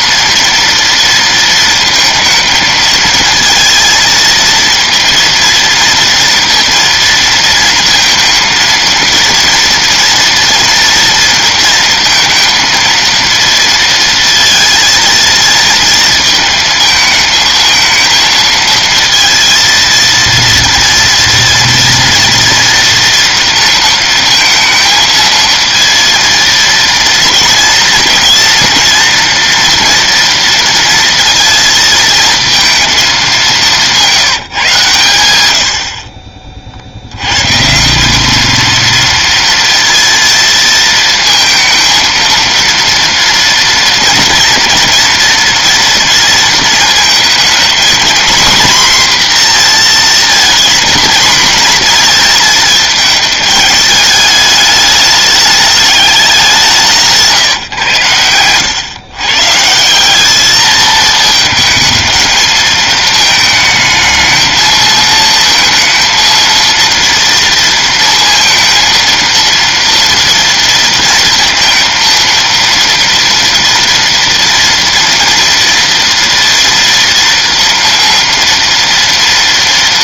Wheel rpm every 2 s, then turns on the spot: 230, 220, 230, 230, 230, 230, 230, 230, 220, 230, 230, 230, 230, 230, 230, 230, 230, 150, 50, 220, 230, 230, 230, 230, 240, 230, 220, 210, 190, 100, 210, 220, 220, 230, 230, 230, 230, 230, 230, 230.
none